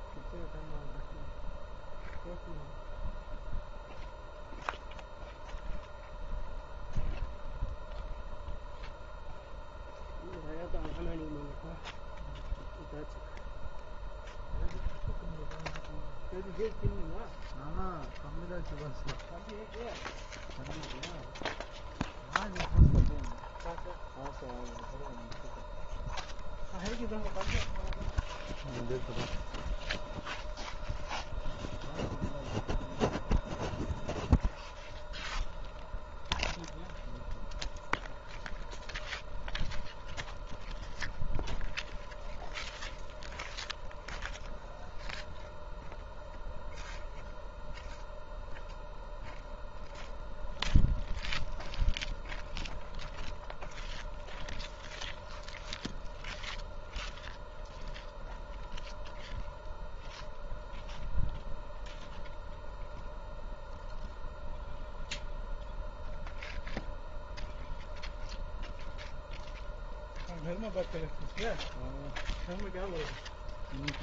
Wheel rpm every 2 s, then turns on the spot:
0, 0, 0, 0, 0, 0, 0, 0, 0, 0, 0, 0, 0, 0, 0, 0, 0, 0, 0, 0, 0, 0, 0, 0, 0, 0, 0, 0, 0, 0, 0, 0, 0, 0, 0, 0, 0.
none